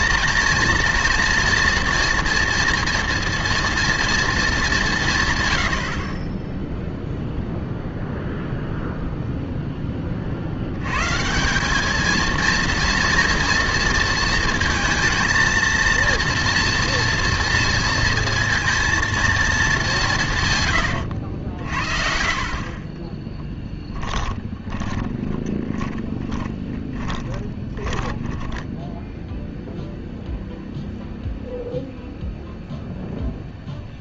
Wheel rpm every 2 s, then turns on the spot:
230, 240, 200, 0, 0, 80, 230, 230, 230, 230, 130, 40, 20, 20, 10, 0, 0.
22-30